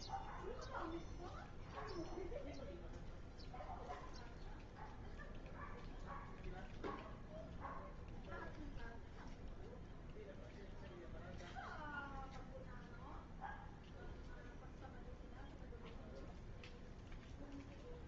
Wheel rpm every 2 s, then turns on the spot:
0, 0, 0, 0, 0, 0, 0, 0, 0.
none